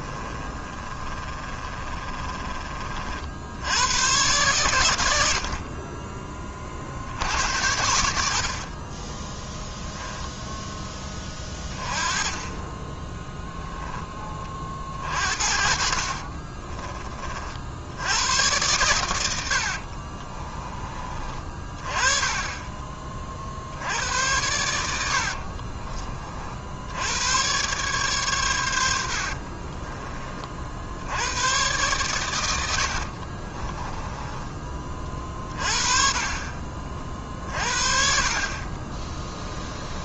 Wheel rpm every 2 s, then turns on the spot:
20, 50, 100, 70, 20, 10, 10, 50, 30, 110, 30, 30, 80, 90, 80, 80, 60, 30, 50, 30.
0-2 8-10 12-14 32-34 38-40